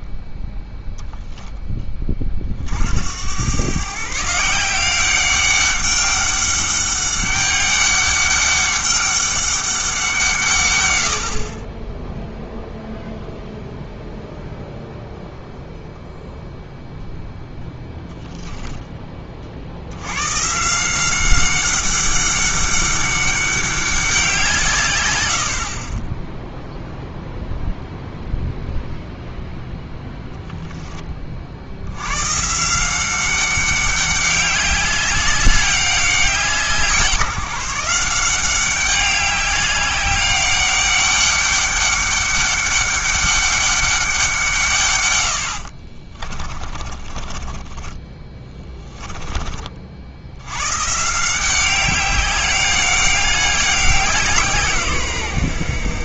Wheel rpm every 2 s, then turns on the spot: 0, 60, 170, 200, 200, 130, 0, 0, 0, 10, 150, 200, 150, 0, 0, 20, 170, 200, 180, 190, 200, 200, 150, 30, 20, 120, 200, 160.
46-50